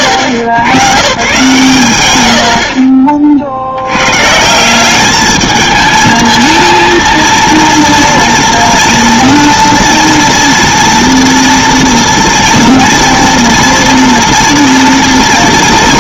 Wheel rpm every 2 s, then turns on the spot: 130, 50, 190, 230, 230, 230, 230, 240.
none